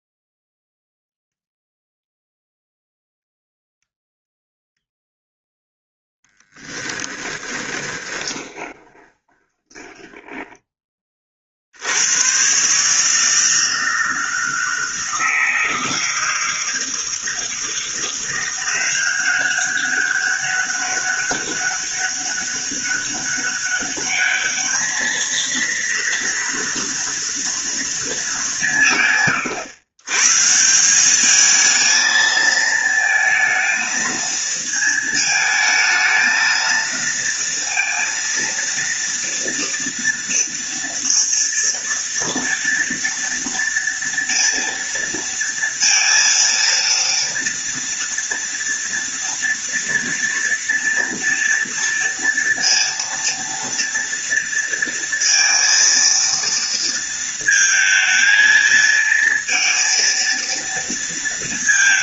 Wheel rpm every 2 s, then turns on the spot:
0, 0, 0, 10, 20, 10, 130, 160, 160, 180, 200, 200, 210, 230, 180, 150, 220, 230, 230, 230, 230, 230, 230, 230, 230, 230, 230, 230, 230, 220, 230.
6-10